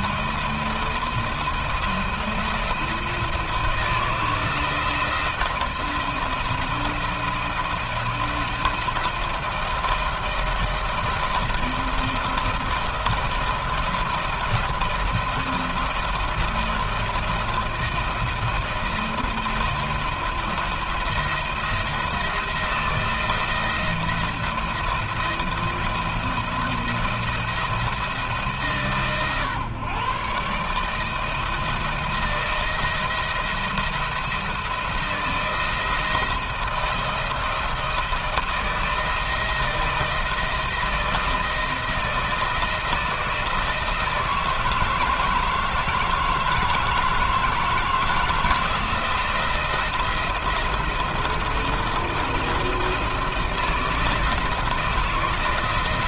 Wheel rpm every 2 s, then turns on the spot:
170, 170, 160, 170, 170, 160, 170, 170, 170, 170, 170, 170, 170, 170, 150, 140, 160, 170, 170, 160, 160, 160, 160, 160, 160, 170, 170, 160.
none